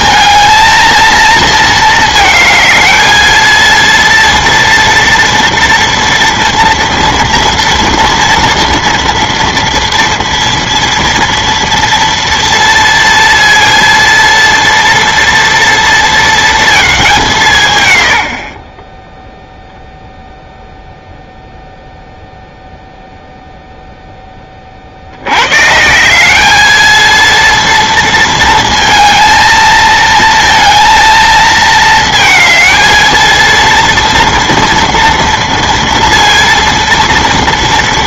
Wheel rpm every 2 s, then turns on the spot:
230, 220, 230, 230, 230, 230, 230, 230, 220, 30, 0, 0, 50, 220, 230, 230, 220, 230, 230.
none